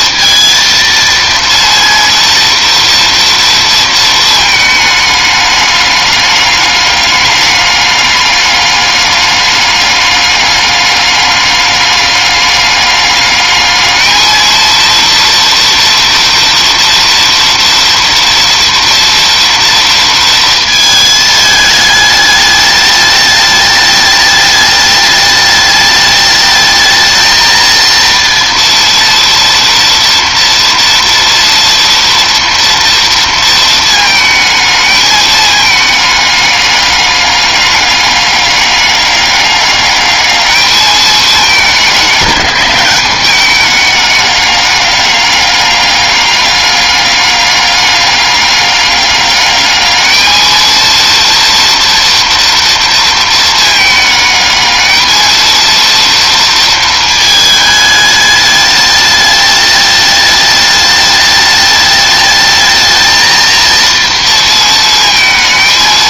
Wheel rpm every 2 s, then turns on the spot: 230, 230, 230, 210, 210, 210, 200, 220, 230, 230, 230, 210, 210, 210, 230, 240, 230, 220, 210, 200, 210, 190, 200, 200, 200, 220, 230, 210, 230, 210, 210, 210, 230.
none